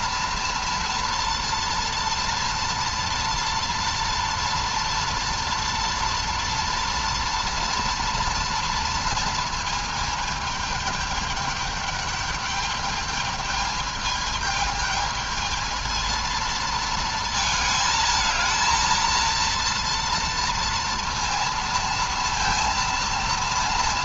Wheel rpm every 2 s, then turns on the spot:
240, 230, 240, 230, 230, 210, 210, 220, 220, 230, 230, 230.
none